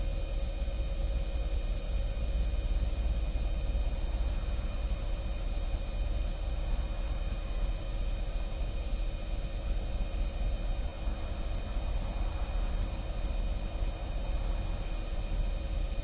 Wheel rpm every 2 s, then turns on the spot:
0, 0, 0, 0, 0, 0, 0, 0.
none